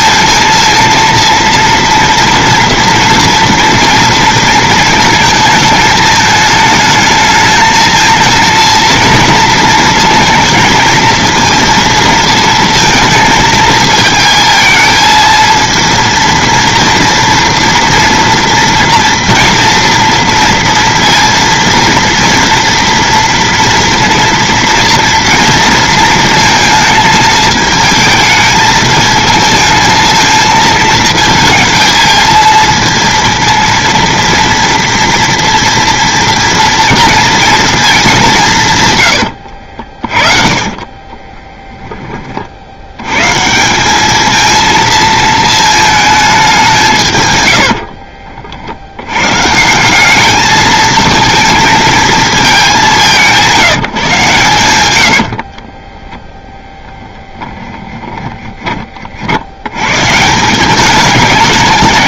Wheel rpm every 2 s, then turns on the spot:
230, 230, 220, 220, 220, 230, 220, 230, 230, 230, 230, 230, 230, 220, 230, 230, 230, 230, 180, 40, 20, 200, 220, 50, 190, 220, 150, 10, 20, 110, 210.
38-40 46-48 54-58